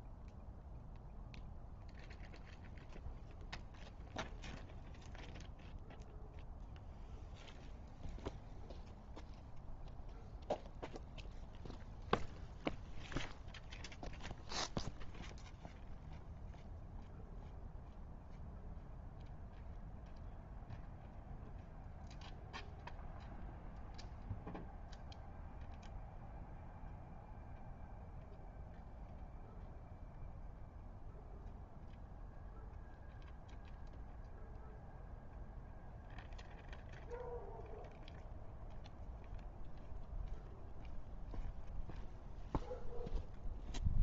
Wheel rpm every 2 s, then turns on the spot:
0, 0, 0, 0, 0, 0, 0, 0, 0, 0, 0, 0, 0, 0, 0, 0, 0, 0, 0, 0, 0, 0.
none